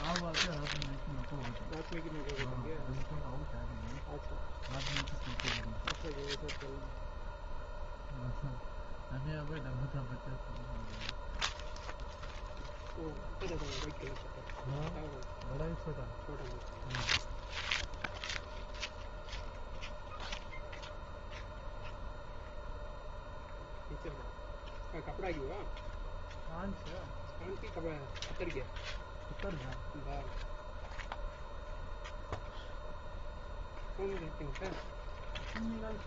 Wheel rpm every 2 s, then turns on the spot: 0, 0, 0, 0, 0, 0, 0, 0, 0, 0, 0, 0, 0, 0, 0, 0, 0, 0.
none